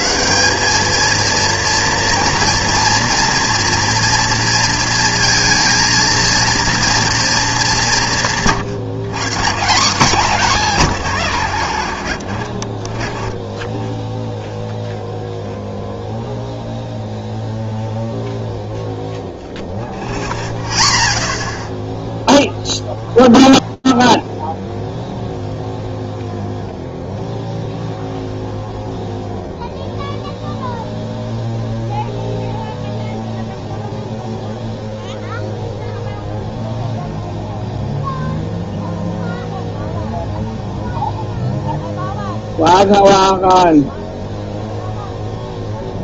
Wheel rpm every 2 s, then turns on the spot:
220, 230, 230, 230, 140, 180, 30, 0, 0, 0, 0, 0, 0, 0, 0, 0, 0, 0, 0, 0, 0, 0, 0.
none